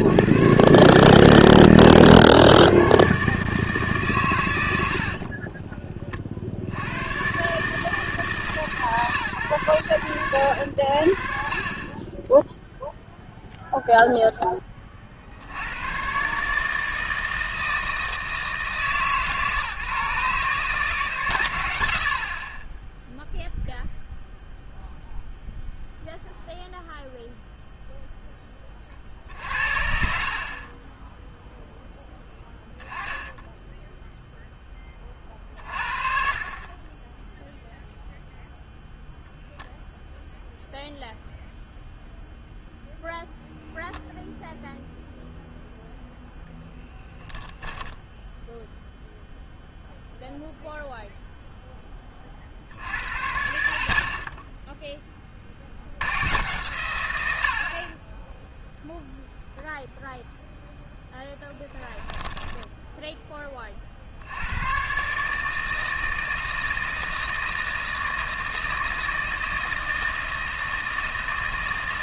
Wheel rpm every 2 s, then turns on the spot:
120, 130, 90, 70, 160, 80, 0, 20, 150, 150, 150, 20, 0, 0, 30, 30, 0, 10, 40, 0, 0, 0, 0, 10, 0, 0, 60, 10, 110, 0, 0, 10, 110, 160, 160, 160.
4-6 22-24 46-48 62-64